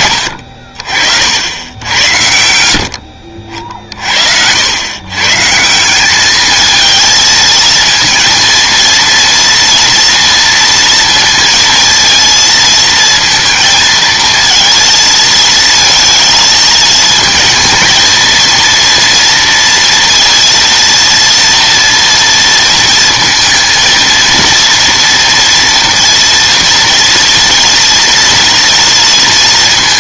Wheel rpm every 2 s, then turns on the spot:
60, 60, 90, 220, 230, 230, 230, 220, 220, 230, 230, 230, 230, 230, 230.
none